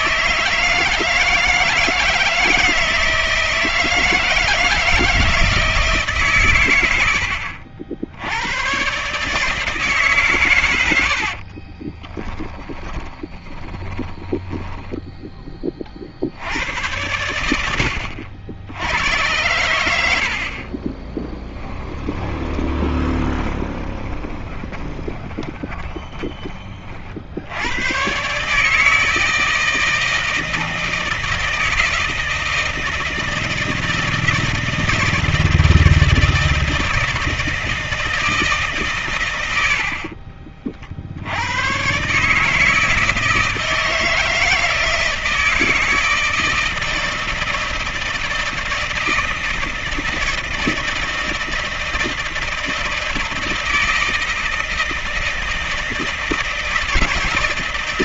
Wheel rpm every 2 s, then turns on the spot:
160, 160, 170, 120, 110, 120, 20, 10, 90, 90, 40, 10, 20, 40, 150, 160, 160, 160, 160, 140, 40, 150, 160, 160, 160, 160, 160, 160, 160.
12-16 20-26